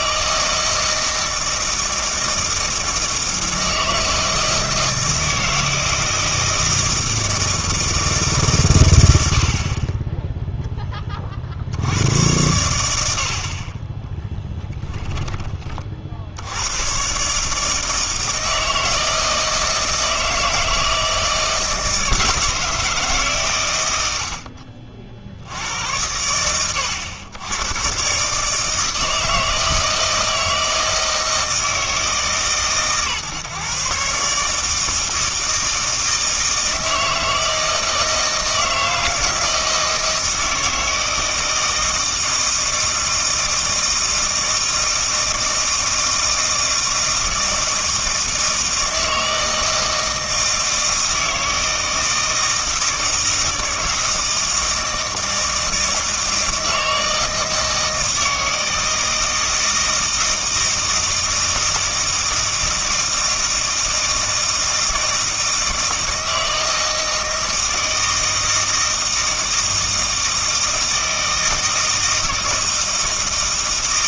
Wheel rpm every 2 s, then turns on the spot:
160, 160, 160, 160, 140, 10, 100, 10, 80, 160, 160, 160, 60, 100, 150, 160, 130, 150, 160, 160, 160, 160, 160, 160, 160, 160, 160, 160, 160, 160, 160, 160, 160, 160, 160, 160, 160.
14-16